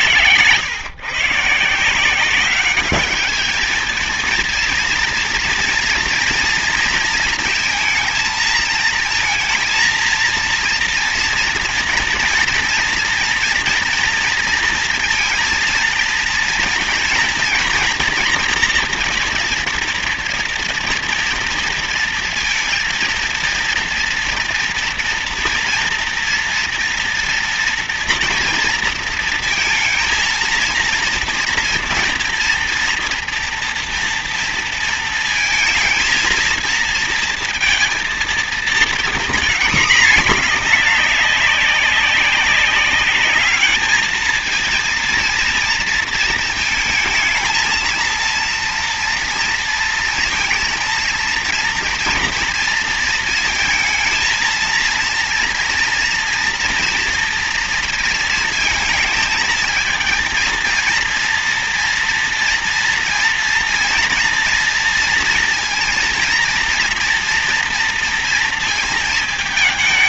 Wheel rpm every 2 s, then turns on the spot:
120, 190, 230, 230, 230, 230, 230, 230, 230, 240, 230, 230, 240, 230, 230, 230, 230, 230, 230, 230, 210, 200, 220, 230, 230, 230, 230, 230, 230, 230, 230, 230, 230, 230, 230.
none